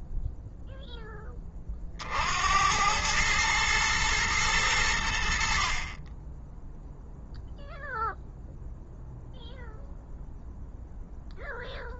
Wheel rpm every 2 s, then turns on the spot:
10, 100, 80, 0, 0, 0.
none